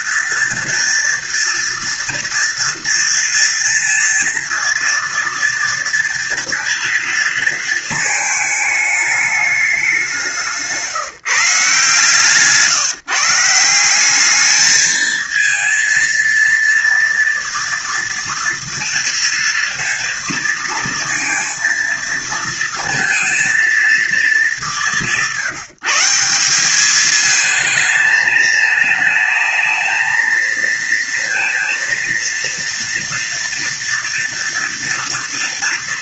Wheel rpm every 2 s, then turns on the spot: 230, 230, 230, 230, 220, 170, 170, 220, 230, 230, 230, 230, 190, 210, 220, 230, 230, 230.
none